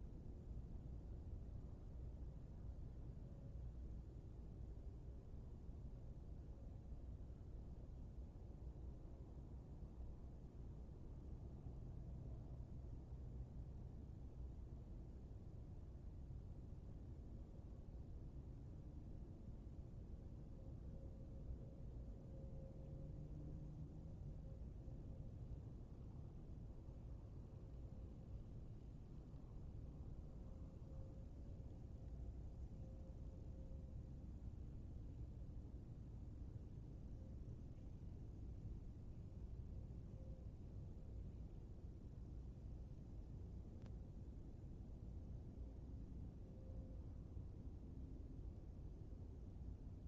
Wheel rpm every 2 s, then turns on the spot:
0, 0, 0, 0, 0, 0, 0, 0, 0, 0, 0, 0, 0, 0, 0, 0, 0, 0, 0, 0, 0, 0, 0, 0, 0.
none